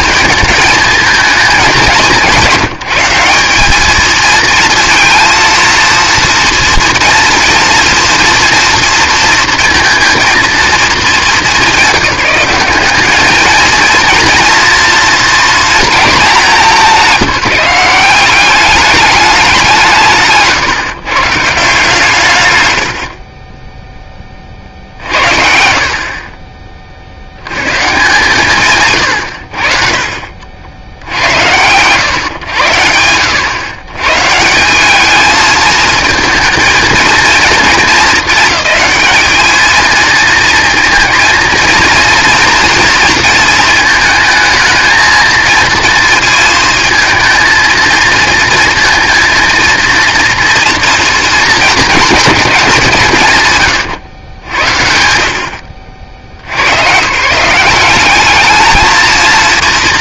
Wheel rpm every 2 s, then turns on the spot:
220, 180, 230, 240, 230, 220, 190, 230, 180, 200, 150, 120, 40, 30, 140, 70, 100, 180, 220, 210, 230, 230, 220, 220, 230, 230, 190, 70, 100, 220.
none